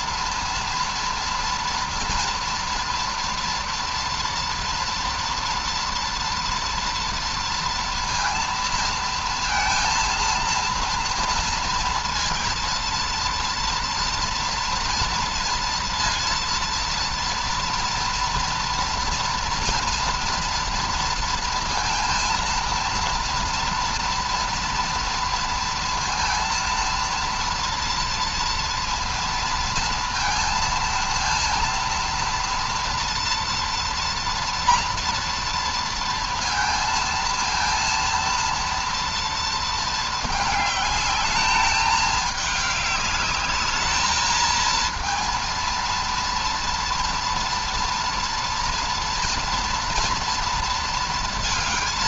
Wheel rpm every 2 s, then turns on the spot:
230, 230, 230, 230, 230, 230, 230, 230, 230, 240, 230, 230, 230, 230, 230, 230, 230, 230, 230, 230, 220, 210, 220, 230, 230, 230.
none